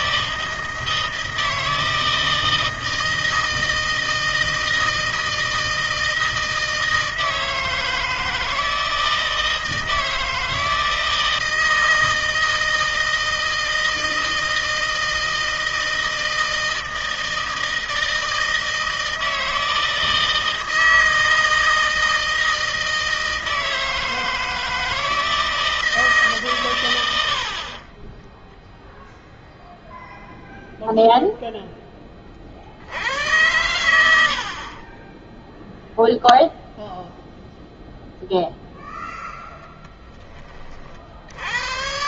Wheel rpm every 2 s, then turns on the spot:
160, 160, 160, 160, 160, 160, 160, 160, 160, 160, 160, 160, 160, 140, 10, 0, 40, 60, 0, 0, 20.
28-30 34-36